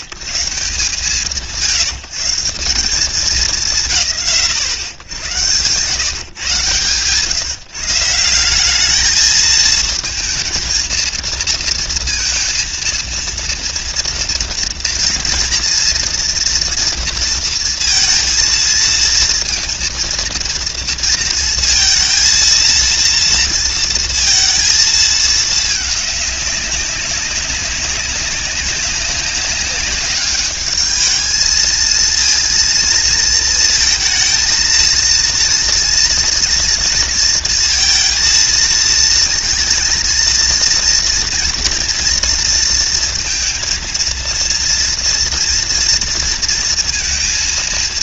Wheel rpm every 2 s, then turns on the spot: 60, 160, 100, 130, 200, 220, 230, 230, 230, 230, 230, 230, 230, 210, 190, 200, 230, 230, 230, 230, 230, 230, 230, 230.
none